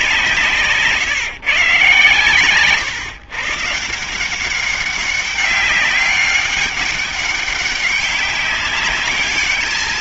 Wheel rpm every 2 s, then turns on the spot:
160, 120, 190, 200, 200.
0-2